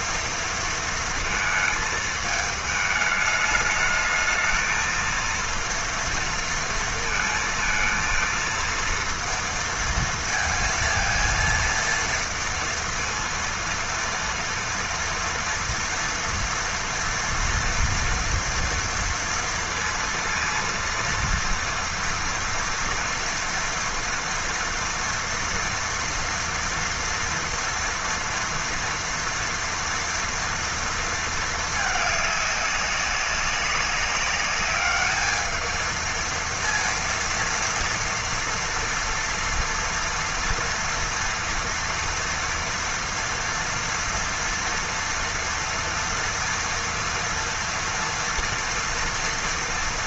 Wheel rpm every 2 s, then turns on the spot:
230, 220, 220, 230, 230, 230, 230, 230, 230, 230, 230, 230, 230, 240, 230, 230, 200, 200, 230, 230, 230, 230, 230, 230, 230.
none